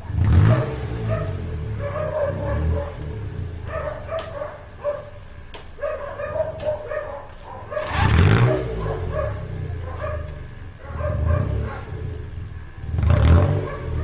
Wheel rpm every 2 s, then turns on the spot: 0, 0, 0, 0, 10, 0, 0.
none